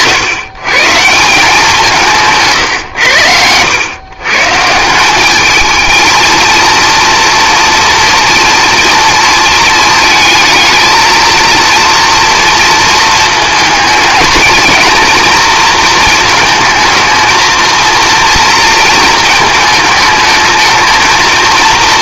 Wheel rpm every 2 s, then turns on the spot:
140, 120, 160, 230, 230, 220, 230, 230, 220, 230, 220.
none